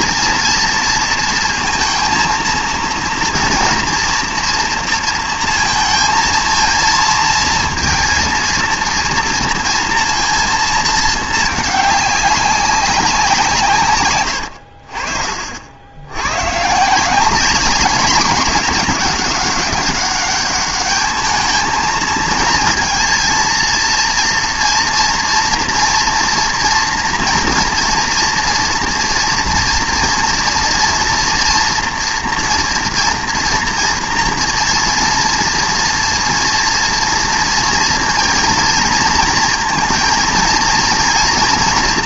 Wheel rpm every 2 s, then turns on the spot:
230, 230, 230, 220, 230, 230, 200, 60, 150, 210, 210, 230, 240, 240, 230, 230, 230, 230, 240, 230, 230.
none